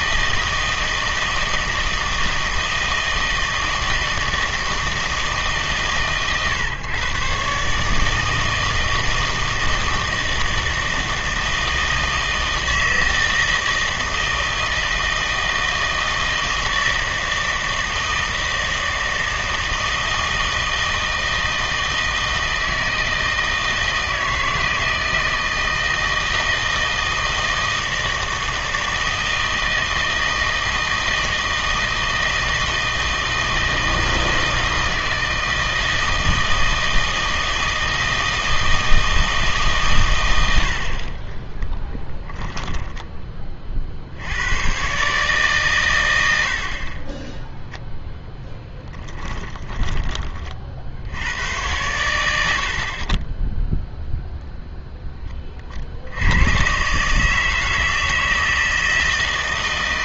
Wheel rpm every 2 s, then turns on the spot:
160, 160, 160, 130, 160, 160, 160, 160, 160, 160, 160, 160, 160, 160, 160, 160, 160, 160, 160, 160, 60, 10, 110, 70, 10, 40, 50, 0, 120, 160.
42-44 48-50